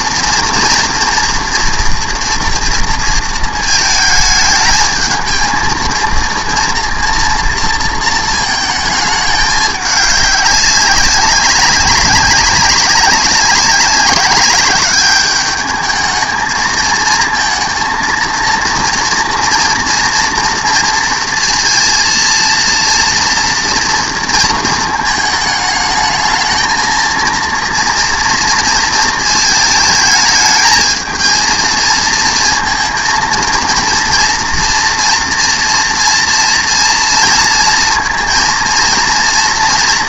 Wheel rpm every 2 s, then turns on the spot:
230, 230, 220, 230, 220, 200, 190, 200, 220, 230, 230, 230, 230, 220, 230, 220, 230, 230, 230, 230.
none